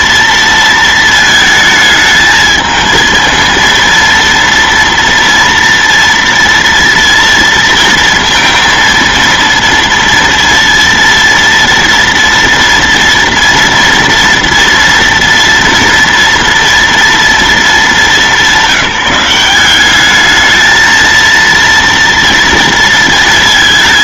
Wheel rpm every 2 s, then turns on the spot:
230, 220, 230, 230, 230, 230, 230, 230, 230, 190, 220, 230.
none